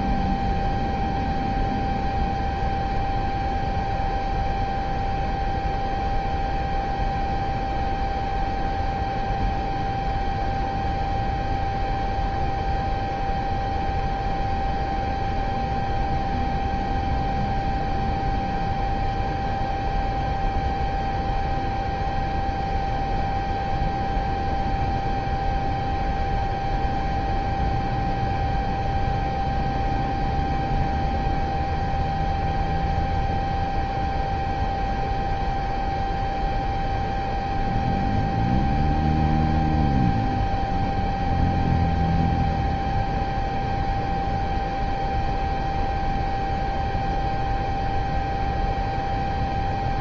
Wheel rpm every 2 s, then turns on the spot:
0, 0, 0, 0, 0, 0, 0, 0, 0, 0, 0, 0, 0, 0, 0, 0, 0, 0, 0, 0, 0, 0, 0, 0, 0.
none